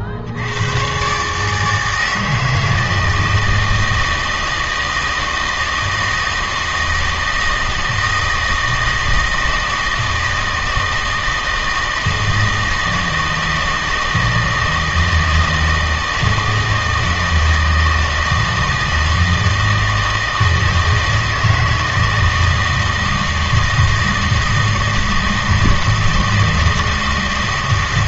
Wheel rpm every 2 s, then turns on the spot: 140, 160, 160, 160, 160, 160, 160, 170, 160, 160, 160, 160, 160, 160.
none